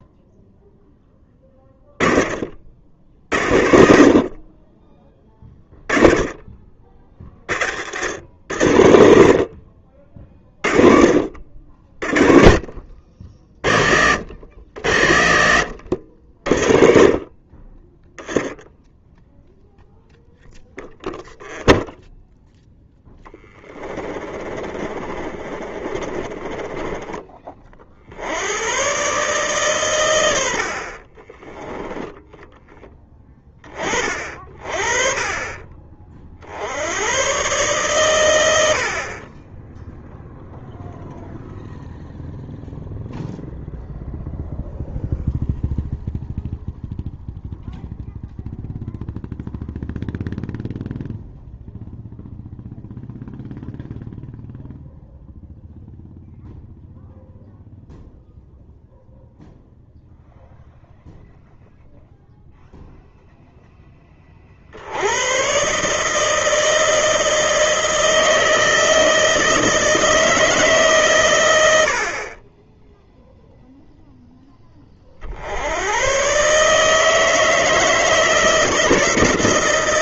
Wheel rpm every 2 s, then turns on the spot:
0, 50, 40, 30, 70, 30, 40, 40, 50, 0, 0, 0, 30, 20, 90, 70, 10, 50, 70, 80, 0, 0, 0, 0, 0, 0, 0, 0, 0, 0, 0, 0, 50, 160, 160, 150, 20, 20, 140, 160.
24-28 34-36